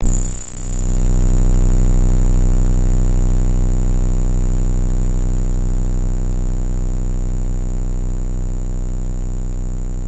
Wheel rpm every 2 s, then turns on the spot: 0, 0, 0, 0, 0.
none